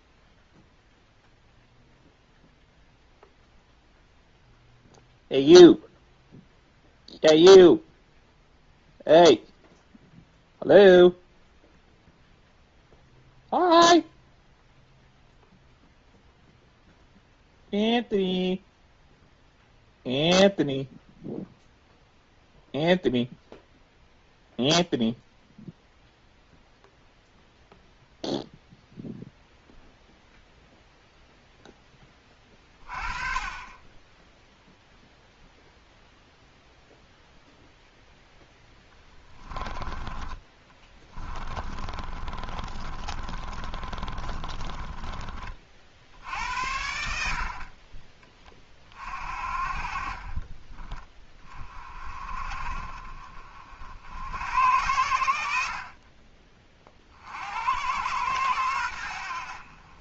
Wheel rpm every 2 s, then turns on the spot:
0, 0, 0, 0, 0, 0, 0, 0, 0, 0, 0, 0, 0, 0, 0, 0, 30, 0, 0, 10, 20, 30, 30, 70, 30, 20, 40, 90, 30, 100.
38-46